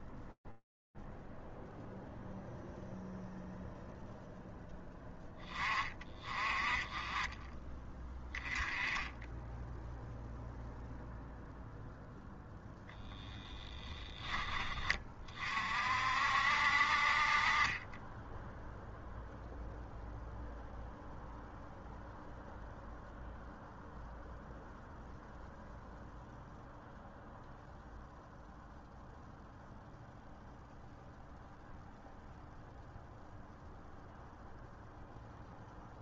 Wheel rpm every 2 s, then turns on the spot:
0, 20, 10, 0, 0, 10, 60, 10, 0, 0, 0, 0, 0, 0, 0, 0, 0, 0.
14-16